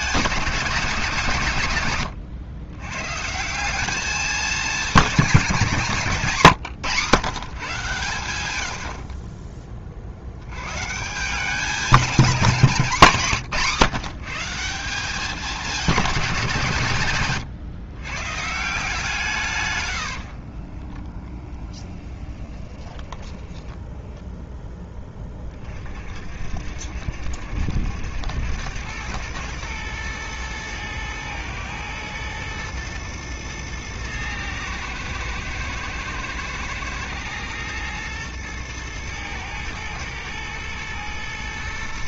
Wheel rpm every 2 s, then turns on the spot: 190, 110, 210, 130, 80, 120, 190, 170, 160, 160, 30, 10, 10, 60, 100, 110, 120, 110, 110, 110, 110.
20-24